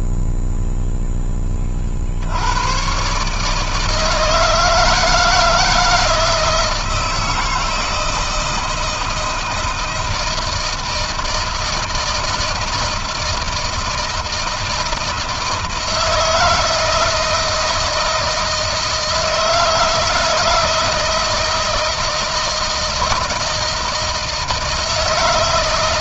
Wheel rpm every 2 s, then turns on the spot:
0, 30, 150, 160, 160, 160, 160, 160, 160, 160, 160, 160, 160.
none